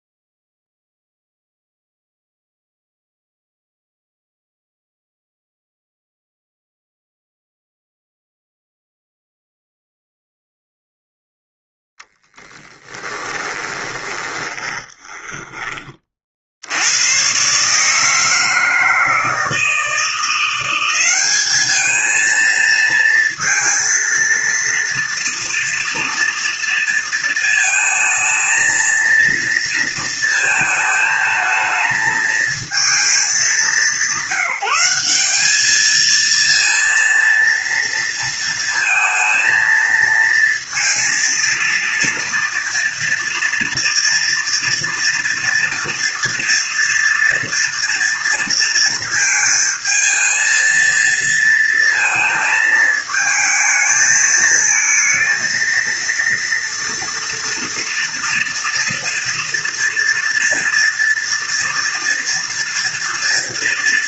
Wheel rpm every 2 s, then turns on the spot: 0, 0, 0, 0, 0, 0, 0, 10, 50, 160, 170, 220, 230, 230, 230, 220, 220, 190, 220, 230, 230, 230, 230, 230, 230, 220, 220, 220, 230, 230, 230, 240.
14-16